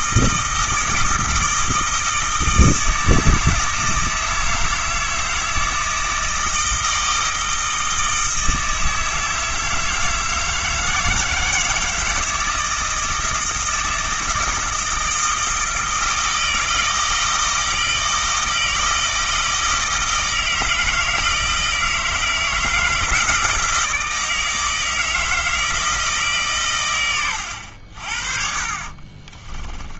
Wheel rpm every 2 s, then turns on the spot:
160, 160, 160, 160, 160, 160, 160, 160, 160, 160, 160, 160, 160, 120, 40.
28-30